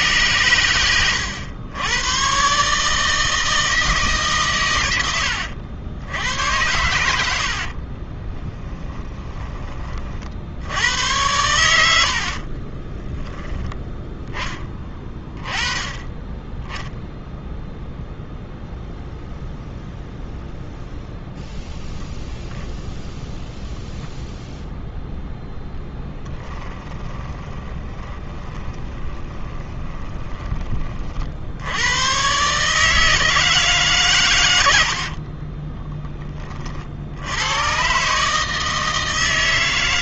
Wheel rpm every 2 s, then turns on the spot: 110, 150, 110, 100, 20, 90, 20, 20, 0, 0, 0, 0, 0, 20, 20, 40, 150, 60, 60, 160.
8-10 12-14 26-30